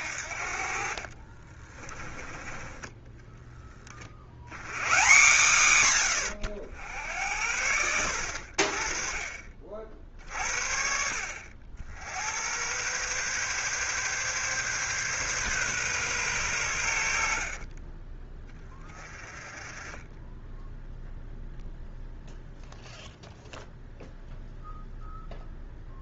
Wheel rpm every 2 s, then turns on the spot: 40, 10, 130, 80, 40, 60, 130, 130, 70, 30, 0, 0, 0.
0-4 16-18